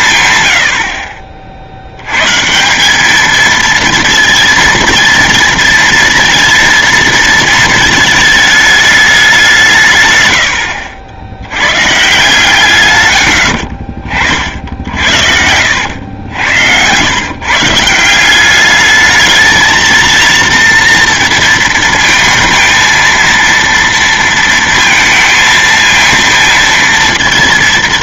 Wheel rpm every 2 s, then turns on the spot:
100, 170, 230, 230, 210, 80, 140, 50, 100, 200, 230, 230, 230, 230.
14-16